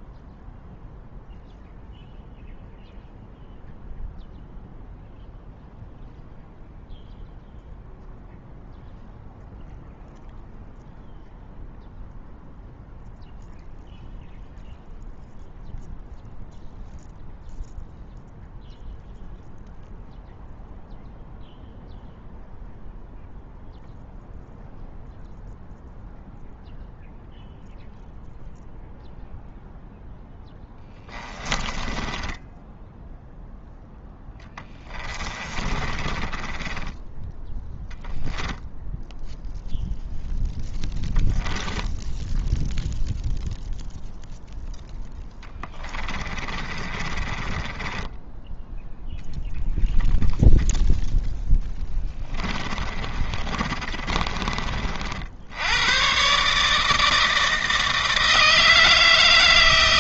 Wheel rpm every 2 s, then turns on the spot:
0, 0, 0, 0, 0, 0, 0, 0, 0, 0, 0, 0, 0, 0, 0, 20, 10, 10, 20, 0, 0, 0, 0, 30, 0, 0, 30, 50, 150, 160.
30-38 46-48 52-54